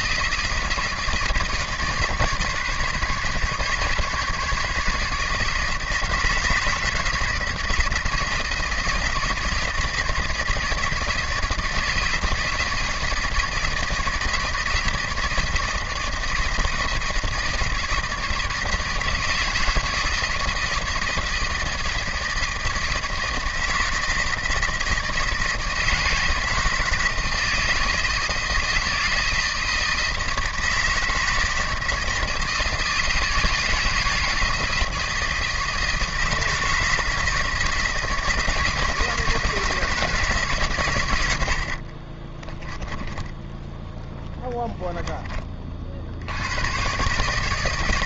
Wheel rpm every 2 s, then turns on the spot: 170, 150, 150, 160, 170, 170, 160, 160, 160, 160, 160, 160, 160, 160, 160, 160, 160, 160, 160, 160, 140, 10, 10, 120.
42-44